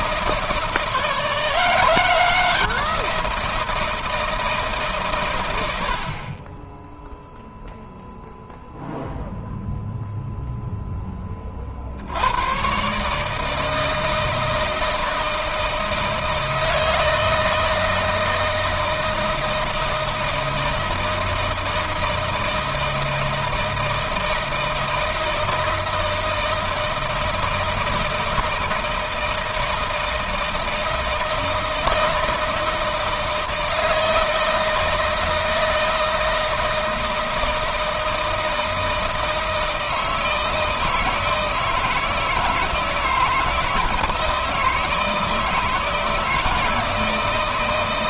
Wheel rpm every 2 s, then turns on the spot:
170, 180, 130, 10, 0, 10, 140, 160, 160, 160, 160, 160, 170, 160, 160, 160, 160, 160, 160, 160, 160, 160, 160, 160.
none